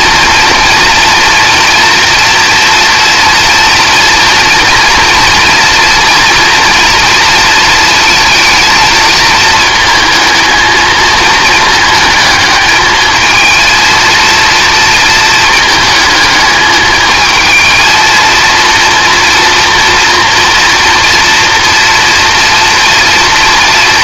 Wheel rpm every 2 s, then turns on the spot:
230, 240, 240, 240, 230, 220, 220, 230, 220, 230, 230, 230.
none